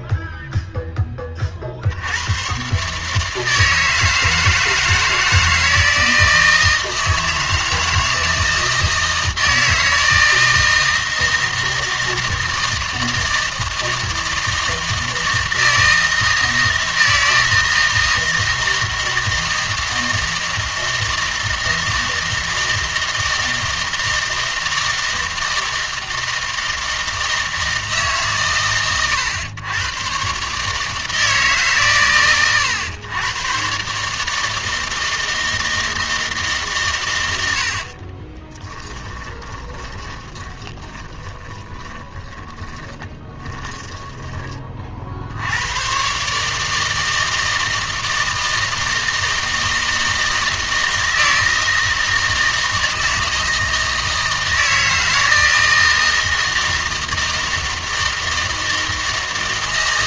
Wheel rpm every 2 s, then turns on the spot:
10, 130, 160, 160, 160, 160, 160, 160, 160, 160, 160, 160, 160, 160, 120, 150, 110, 160, 140, 20, 20, 30, 40, 160, 160, 160, 160, 160, 160, 160.
38-44